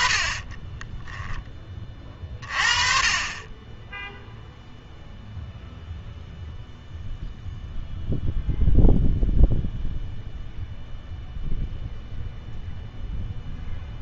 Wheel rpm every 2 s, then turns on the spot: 10, 30, 0, 0, 0, 0, 0.
0-2